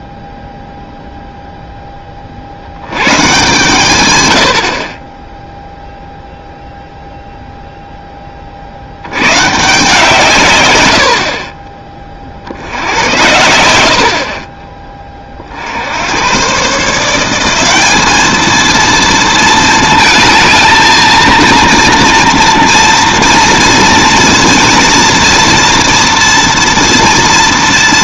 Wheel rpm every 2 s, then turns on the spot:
0, 80, 50, 0, 50, 120, 70, 20, 130, 220, 220, 230, 230, 230.
4-6